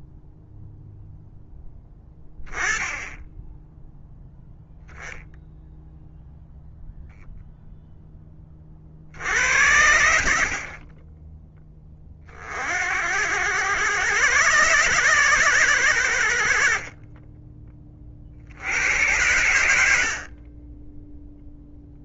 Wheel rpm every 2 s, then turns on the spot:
0, 10, 0, 0, 30, 50, 50, 130, 60, 70, 20.
none